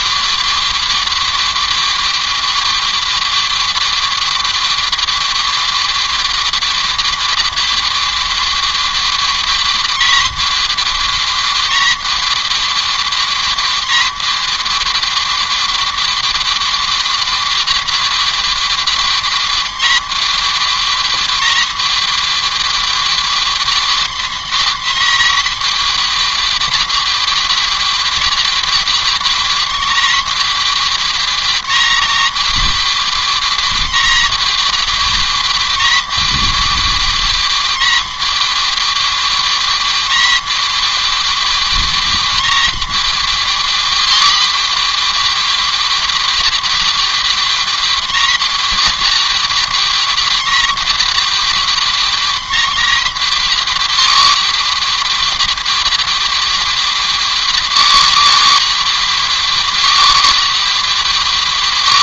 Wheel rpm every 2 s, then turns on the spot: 270, 270, 270, 270, 270, 270, 270, 270, 270, 270, 270, 270, 270, 270, 270, 270, 270, 260, 270, 270, 270, 270, 270, 260, 270, 270, 270, 270, 270, 270, 270.
none